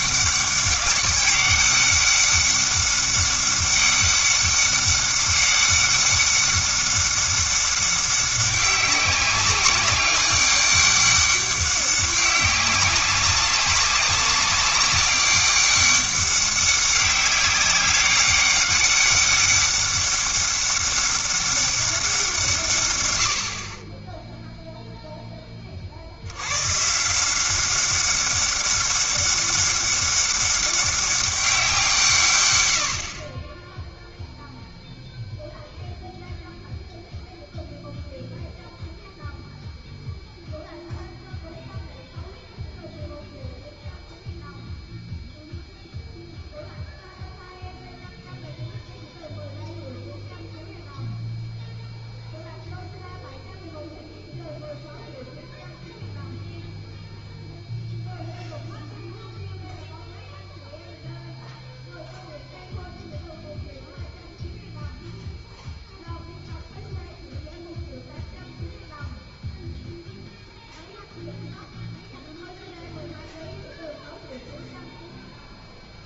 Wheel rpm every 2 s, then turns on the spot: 200, 200, 200, 200, 200, 200, 200, 200, 200, 200, 200, 140, 0, 130, 200, 190, 80, 0, 0, 0, 0, 0, 0, 0, 0, 0, 0, 0, 0, 0, 0, 0, 0, 0, 0, 0, 0, 0.
none